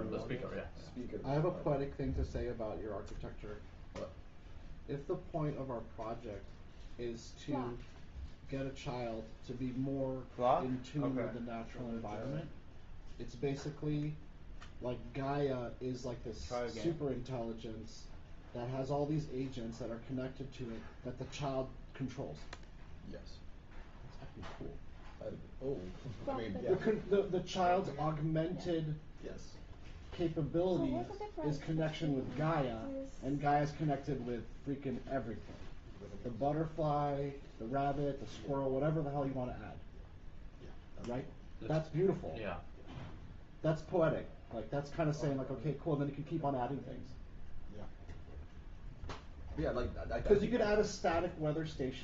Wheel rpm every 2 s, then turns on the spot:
0, 0, 0, 0, 0, 0, 0, 0, 0, 0, 0, 0, 0, 0, 0, 0, 0, 0, 0, 0, 0, 0, 0, 0, 0, 0.
none